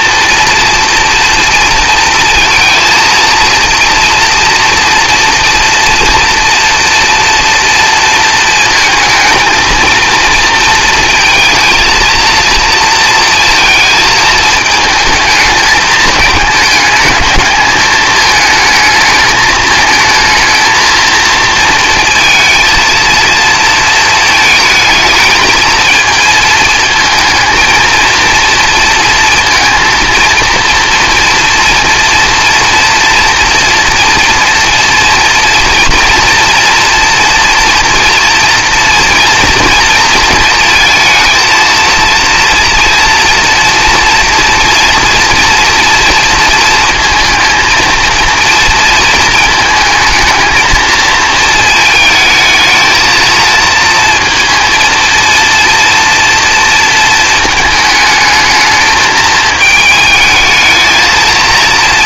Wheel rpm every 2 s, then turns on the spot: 230, 230, 230, 230, 230, 230, 230, 220, 210, 220, 220, 230, 220, 230, 230, 230, 240, 240, 240, 230, 230, 230, 230, 230, 230, 220, 220, 230, 230, 220, 220.
none